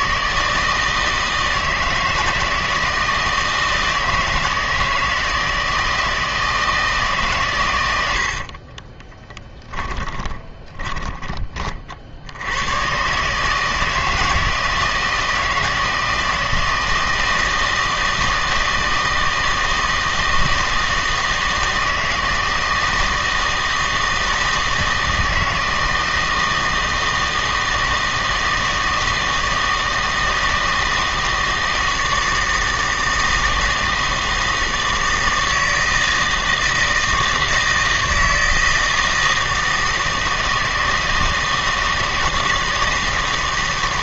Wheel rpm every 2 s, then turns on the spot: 160, 160, 160, 160, 40, 20, 110, 160, 160, 160, 160, 160, 160, 160, 160, 160, 160, 160, 160, 160, 160, 160.
8-12